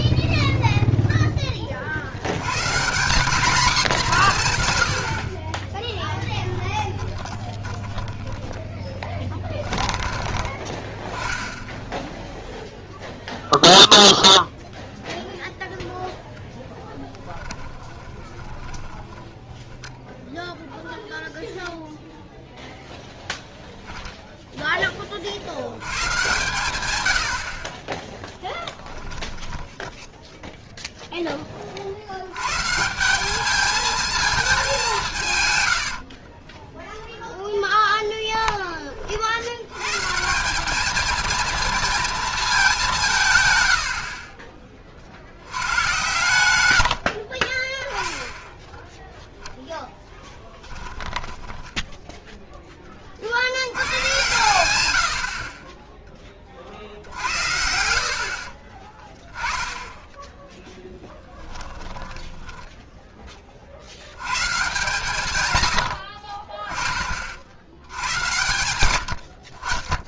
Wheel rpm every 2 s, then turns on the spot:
20, 110, 160, 10, 10, 10, 0, 0, 0, 30, 10, 0, 0, 130, 10, 0, 90, 220, 40, 10, 160, 220, 40, 110, 10, 10, 0, 120, 20, 60, 10, 10, 120, 50, 130.
0-2 6-8 18-20 28-30 36-38 44-46 50-52 62-64